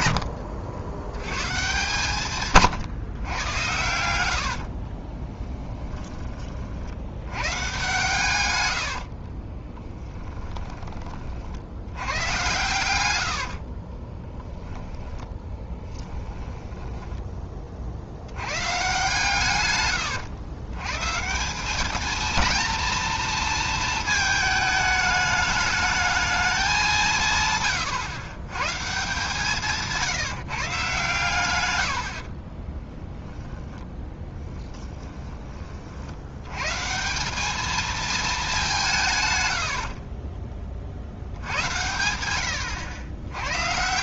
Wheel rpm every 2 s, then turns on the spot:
80, 140, 50, 60, 80, 20, 110, 10, 10, 130, 120, 230, 210, 190, 140, 150, 10, 10, 130, 180, 40, 90.
4-6 8-10 14-18 32-36 42-44